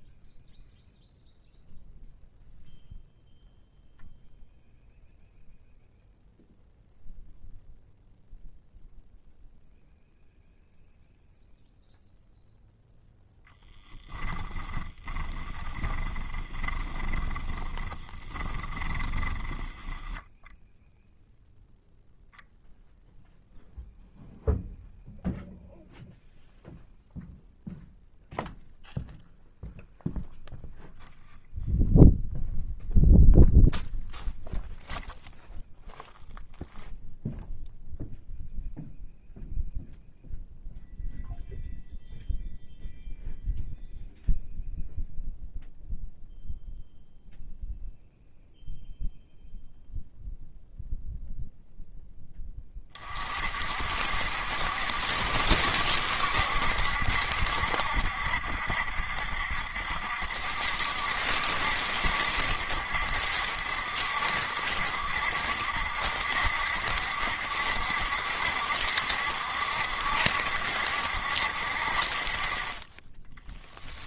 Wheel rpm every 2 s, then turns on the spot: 0, 0, 0, 0, 0, 0, 0, 20, 20, 20, 0, 0, 0, 0, 0, 0, 0, 0, 0, 0, 0, 0, 0, 0, 0, 0, 20, 70, 70, 70, 70, 70, 70, 70, 70, 70, 30.
14-20